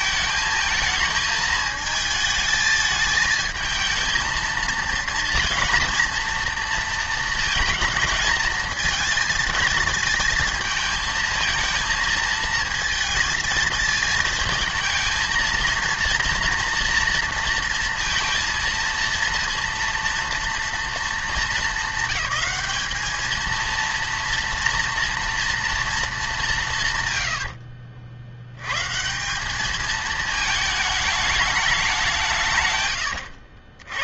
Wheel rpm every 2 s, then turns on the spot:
220, 220, 220, 230, 220, 220, 230, 220, 230, 230, 220, 200, 230, 170, 110, 220, 130.
none